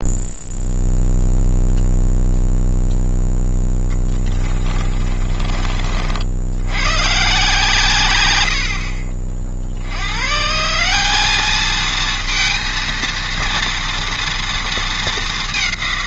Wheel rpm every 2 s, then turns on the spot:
0, 0, 30, 120, 60, 190, 230, 220.
4-6 8-10